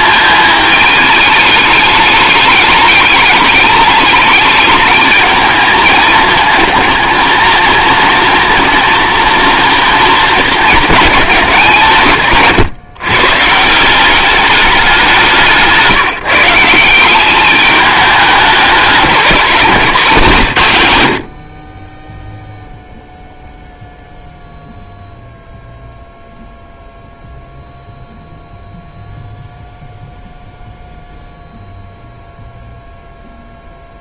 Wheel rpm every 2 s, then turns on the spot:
220, 210, 210, 220, 240, 210, 140, 200, 170, 210, 130, 0, 0, 0, 0, 0, 0.
none